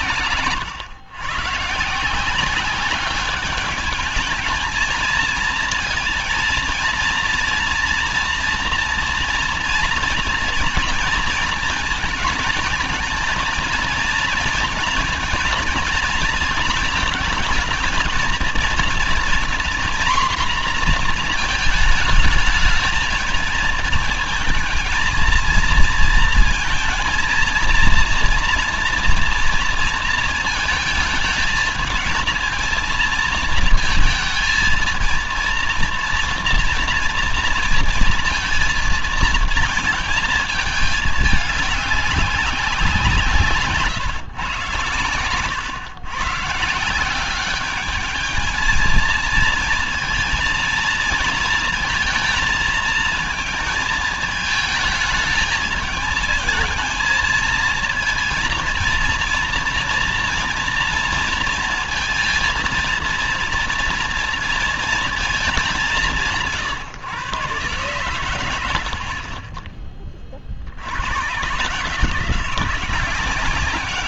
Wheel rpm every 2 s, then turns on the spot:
120, 190, 220, 230, 230, 230, 230, 230, 230, 230, 250, 220, 220, 230, 230, 230, 230, 230, 230, 230, 220, 190, 130, 150, 220, 230, 230, 220, 220, 230, 230, 230, 230, 160, 90, 50, 180.
none